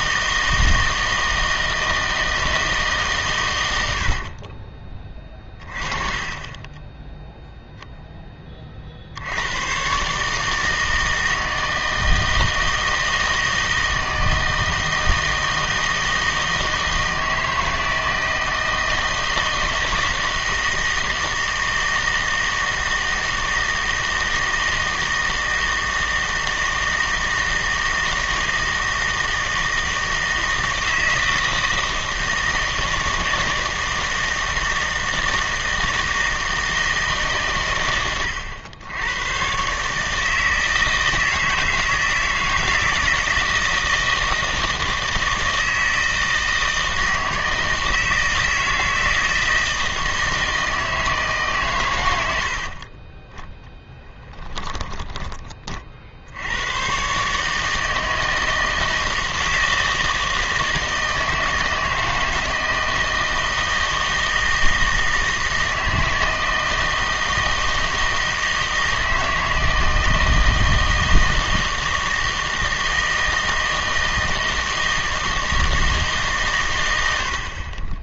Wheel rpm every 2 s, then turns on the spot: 160, 150, 30, 20, 40, 160, 160, 160, 160, 160, 160, 160, 160, 160, 160, 160, 160, 160, 160, 100, 160, 160, 160, 160, 160, 160, 50, 10, 100, 160, 160, 160, 160, 160, 160, 160, 160, 160, 110.
4-6 54-56